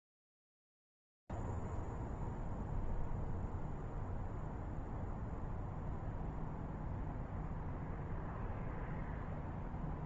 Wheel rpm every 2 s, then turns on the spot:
0, 0, 0, 0, 0.
none